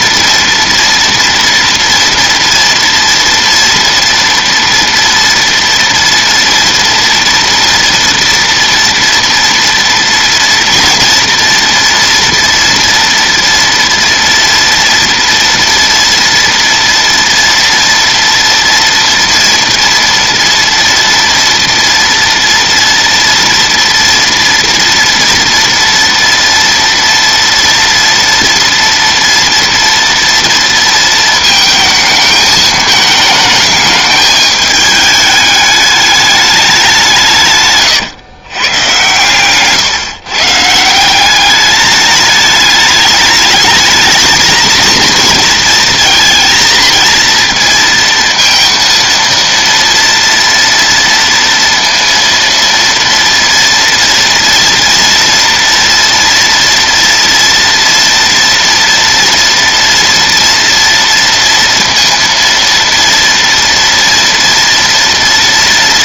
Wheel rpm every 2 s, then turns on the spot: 230, 230, 230, 230, 230, 230, 230, 230, 240, 230, 240, 230, 230, 230, 230, 230, 220, 210, 200, 120, 150, 210, 230, 230, 230, 230, 230, 230, 230, 230, 240, 230, 230.
none